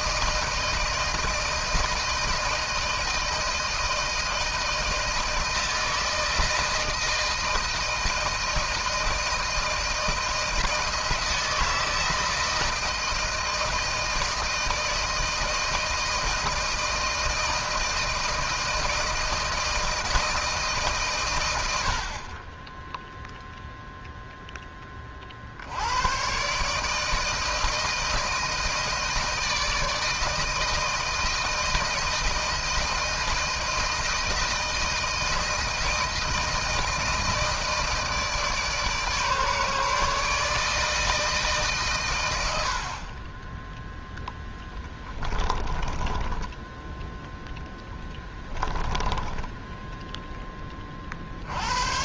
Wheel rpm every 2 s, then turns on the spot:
160, 160, 160, 160, 160, 160, 160, 160, 160, 160, 160, 40, 10, 130, 160, 160, 160, 160, 160, 150, 150, 90, 10, 10, 10, 20.
44-50